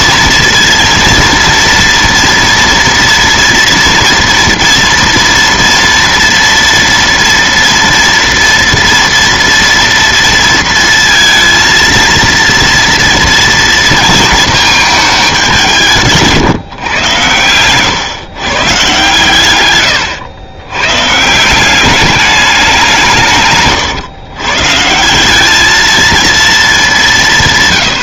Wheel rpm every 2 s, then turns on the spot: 230, 230, 230, 230, 230, 230, 230, 220, 130, 130, 120, 190, 150, 210.
none